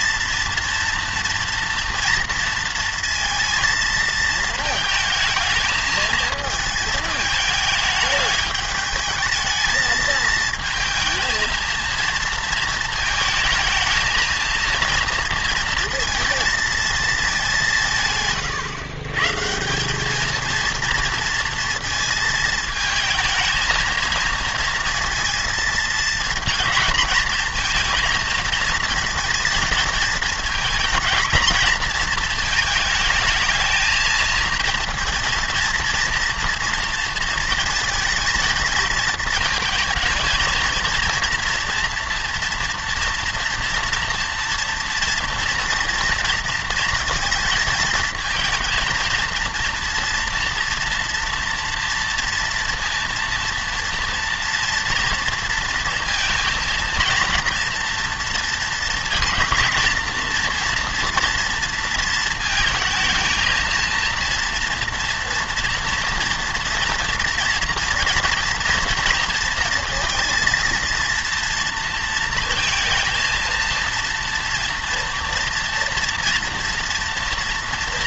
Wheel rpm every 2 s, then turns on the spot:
230, 230, 220, 220, 210, 220, 220, 230, 220, 140, 230, 220, 230, 230, 230, 230, 220, 230, 230, 220, 230, 230, 230, 230, 220, 230, 230, 230, 230, 230, 230, 230, 230, 230, 230, 230, 230, 230, 230.
none